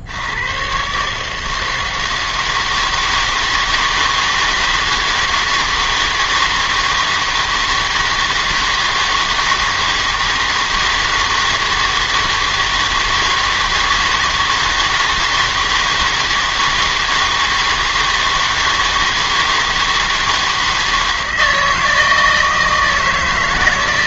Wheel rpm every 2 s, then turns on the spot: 120, 160, 160, 160, 160, 160, 160, 160, 160, 160, 160, 160.
none